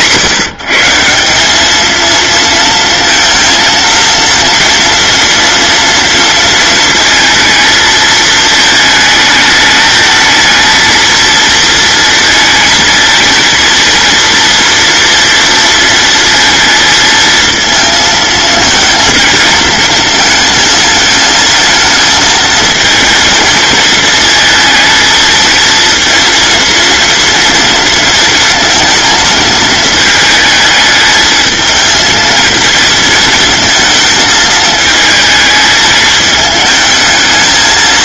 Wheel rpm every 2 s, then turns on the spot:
160, 230, 230, 230, 220, 230, 230, 230, 230, 230, 220, 220, 220, 230, 230, 220, 230, 220, 220.
none